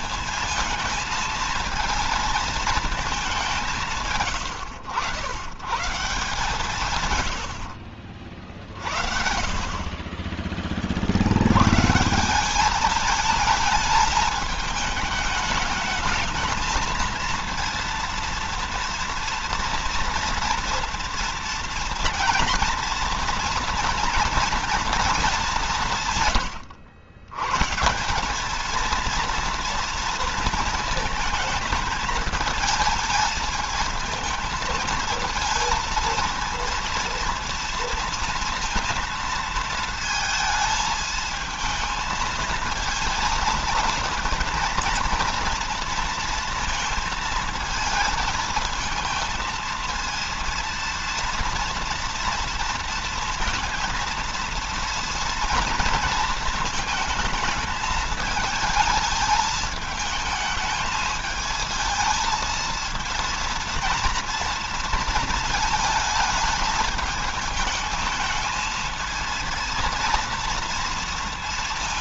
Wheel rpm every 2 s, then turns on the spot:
230, 220, 110, 140, 60, 60, 210, 210, 220, 230, 230, 230, 220, 90, 230, 220, 220, 220, 230, 230, 220, 220, 230, 230, 220, 230, 230, 230, 220, 220, 220, 220, 230, 220, 230, 230.
8-10